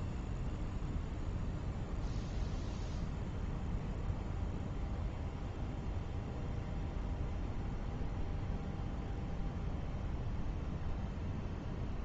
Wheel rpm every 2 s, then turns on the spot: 0, 0, 0, 0, 0, 0.
none